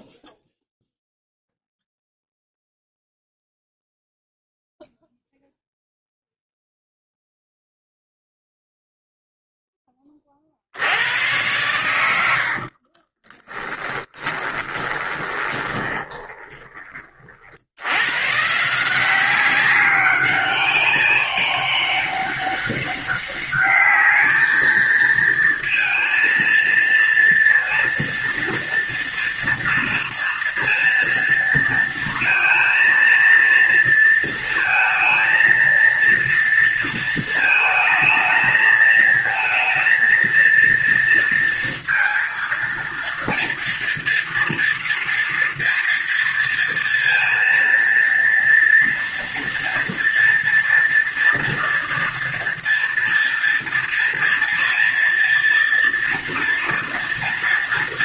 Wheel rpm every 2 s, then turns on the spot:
0, 0, 0, 0, 0, 50, 70, 10, 20, 140, 190, 200, 220, 230, 240, 230, 230, 230, 230, 220, 230, 230, 230, 230, 230, 230, 230, 230, 240.
14-18